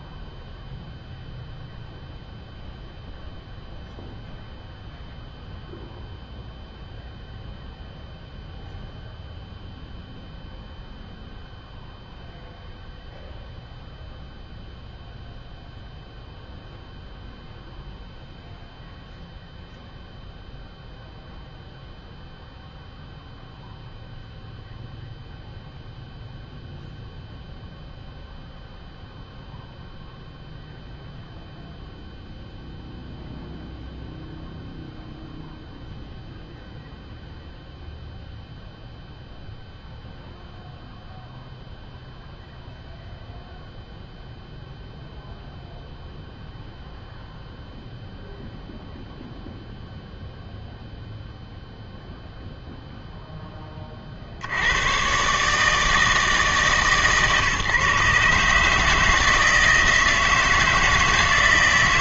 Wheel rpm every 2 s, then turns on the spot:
0, 0, 0, 0, 0, 0, 0, 0, 0, 0, 0, 0, 0, 0, 0, 0, 0, 0, 0, 0, 0, 0, 0, 0, 0, 0, 0, 100, 150, 150, 160.
none